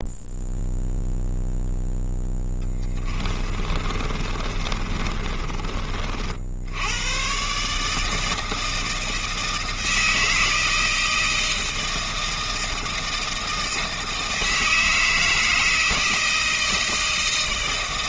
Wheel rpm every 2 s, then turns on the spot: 0, 20, 30, 90, 160, 160, 160, 160, 160.
2-6